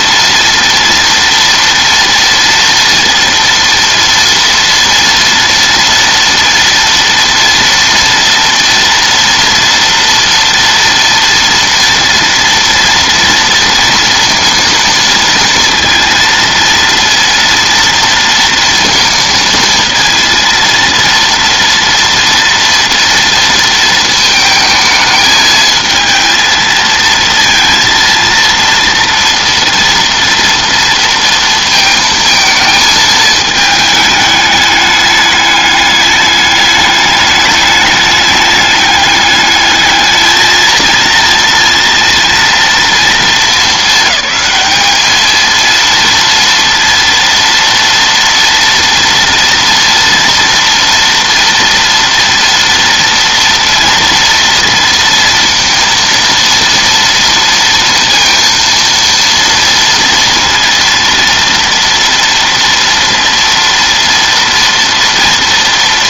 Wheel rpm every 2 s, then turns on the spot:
230, 230, 230, 230, 230, 230, 230, 230, 230, 230, 230, 240, 220, 220, 230, 230, 220, 210, 210, 210, 230, 230, 210, 230, 230, 230, 230, 230, 230, 230, 230, 230, 230.
none